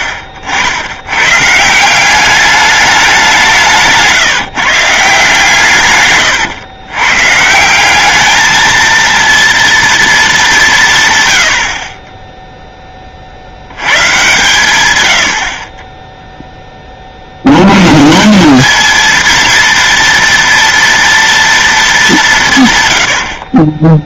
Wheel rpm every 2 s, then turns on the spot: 80, 210, 160, 120, 220, 180, 0, 120, 10, 200, 230, 140.
0-2